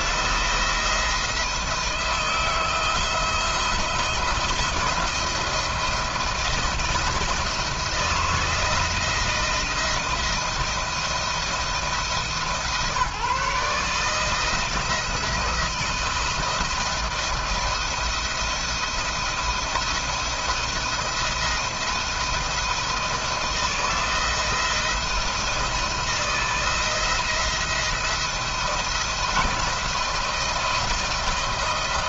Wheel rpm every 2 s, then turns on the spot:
170, 160, 170, 170, 160, 170, 160, 160, 170, 170, 170, 170, 170, 170, 170, 160.
none